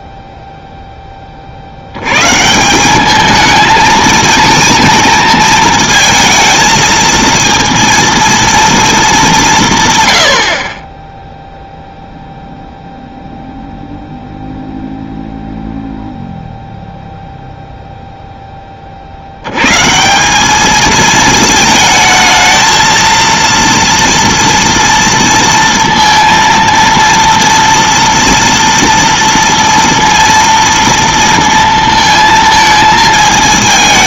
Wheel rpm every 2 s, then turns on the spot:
0, 170, 230, 220, 230, 40, 0, 0, 0, 30, 210, 220, 230, 230, 230, 230, 220.
none